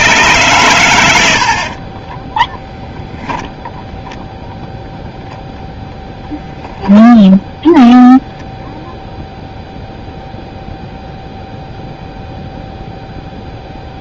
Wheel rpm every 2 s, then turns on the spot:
110, 10, 0, 0, 0, 0, 0.
2-4